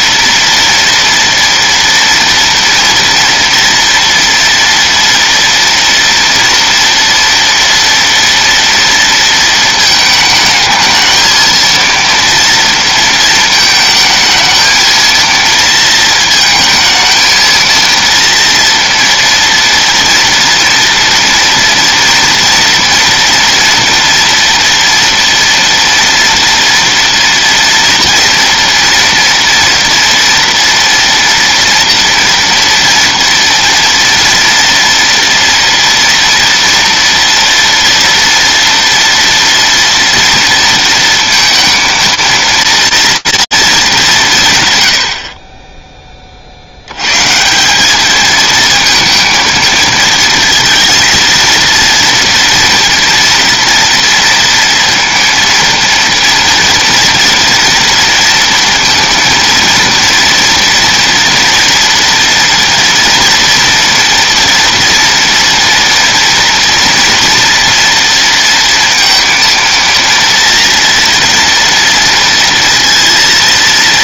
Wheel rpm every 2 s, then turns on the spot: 230, 230, 240, 230, 230, 220, 230, 220, 230, 230, 230, 230, 230, 230, 230, 230, 240, 230, 230, 230, 230, 230, 110, 70, 230, 230, 230, 230, 230, 230, 240, 230, 230, 230, 230, 230, 230.
none